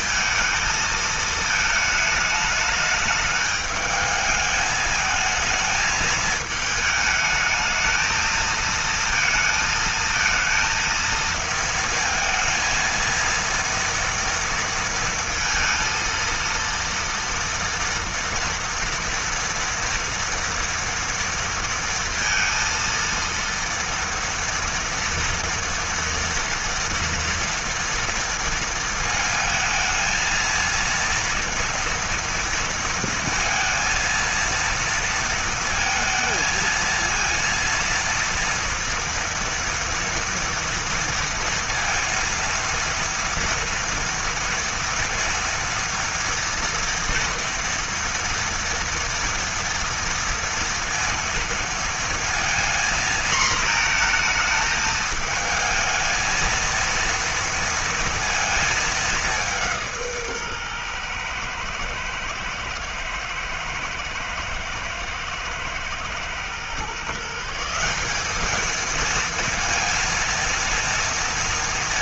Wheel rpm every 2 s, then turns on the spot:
220, 210, 220, 220, 230, 230, 230, 230, 230, 230, 230, 230, 230, 230, 220, 230, 230, 230, 230, 230, 230, 230, 230, 230, 230, 230, 230, 220, 230, 200, 120, 110, 110, 150, 230, 230.
none